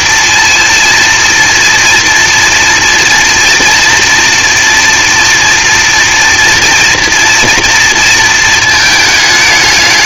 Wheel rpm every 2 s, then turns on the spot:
230, 230, 230, 240, 220.
none